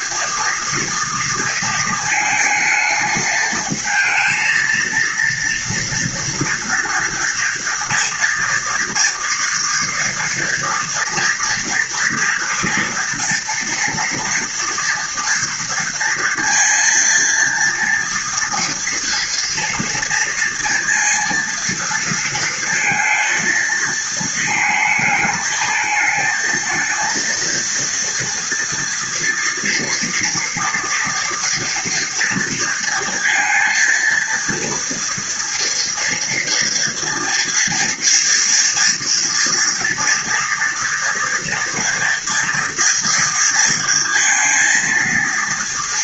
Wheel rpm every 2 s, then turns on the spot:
230, 220, 230, 230, 230, 230, 230, 230, 230, 230, 230, 230, 220, 220, 230, 230, 240, 230, 230, 230, 230, 230, 230.
none